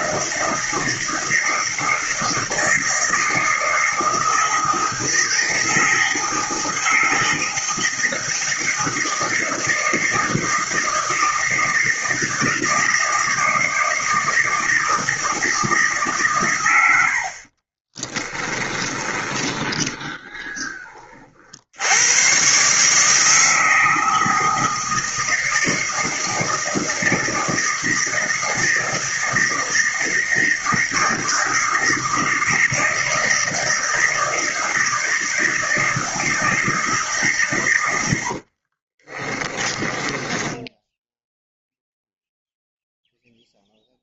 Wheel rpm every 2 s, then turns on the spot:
160, 160, 160, 160, 160, 160, 160, 160, 100, 20, 20, 140, 160, 160, 160, 160, 160, 160, 160, 50, 10, 0.
18-20 38-40